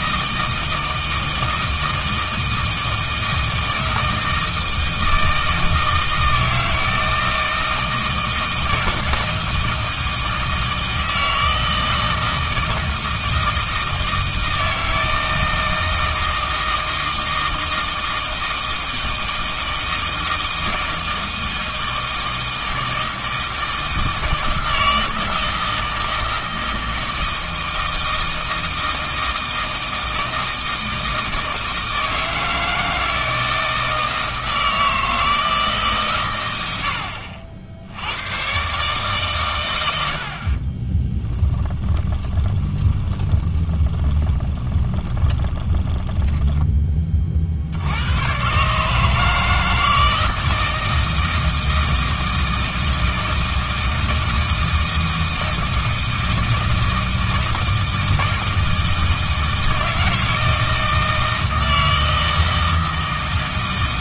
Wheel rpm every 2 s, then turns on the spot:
160, 160, 160, 160, 160, 160, 160, 160, 160, 160, 160, 160, 160, 160, 160, 160, 160, 160, 70, 130, 30, 20, 10, 20, 140, 160, 160, 160, 160, 160, 160, 160.
40-46